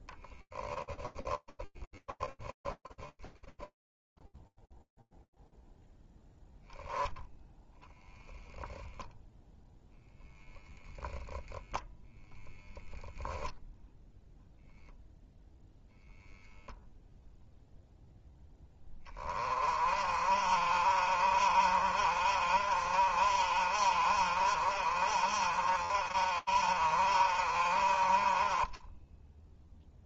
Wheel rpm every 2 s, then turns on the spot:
0, 10, 0, 0, 0, 0, 0, 0, 0, 40, 50, 50, 50, 20, 0.
2-4